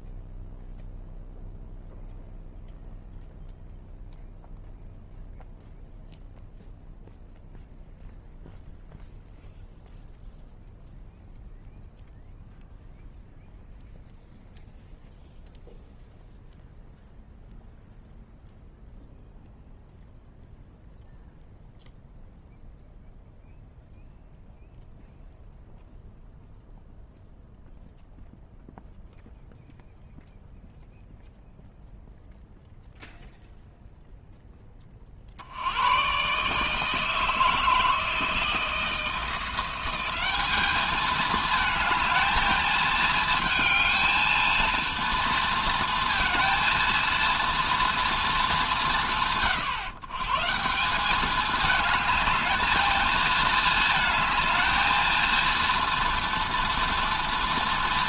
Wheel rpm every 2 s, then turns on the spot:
0, 0, 0, 0, 0, 0, 0, 0, 0, 0, 0, 0, 0, 0, 0, 0, 0, 10, 150, 160, 200, 220, 230, 230, 210, 150, 220, 220, 230.
none